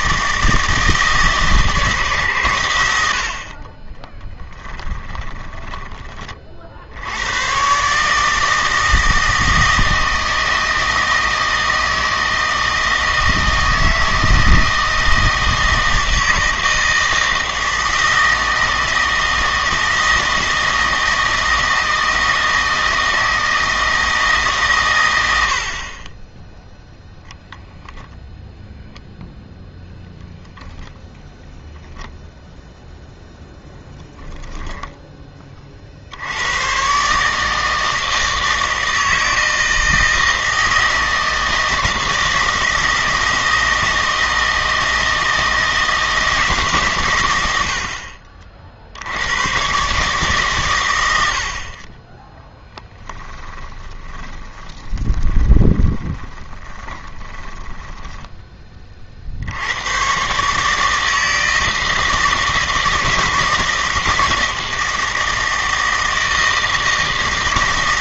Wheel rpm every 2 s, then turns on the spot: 160, 110, 10, 60, 160, 160, 160, 160, 160, 160, 160, 160, 130, 0, 0, 0, 0, 0, 110, 160, 160, 160, 160, 140, 50, 120, 10, 20, 20, 30, 150, 160, 160, 160.
4-6 52-58